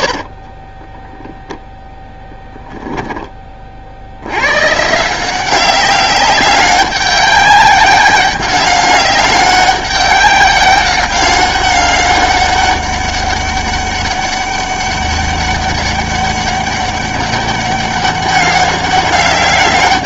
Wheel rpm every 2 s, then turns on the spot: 30, 10, 120, 200, 200, 200, 200, 200, 200, 200.
0-2